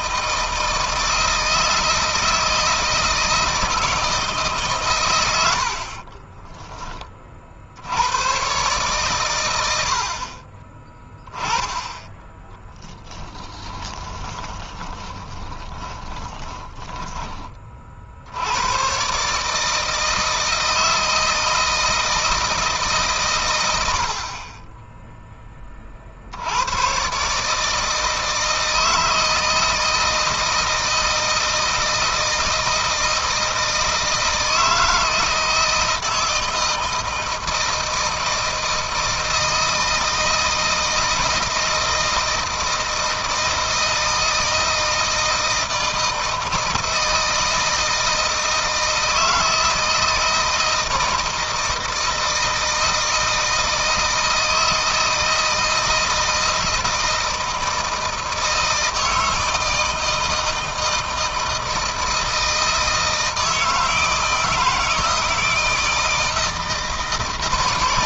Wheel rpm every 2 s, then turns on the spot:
160, 160, 130, 20, 120, 30, 20, 20, 20, 120, 160, 150, 20, 100, 160, 160, 160, 160, 160, 160, 160, 160, 160, 160, 160, 160, 160, 160, 160, 160, 160, 160, 160, 160.
12-18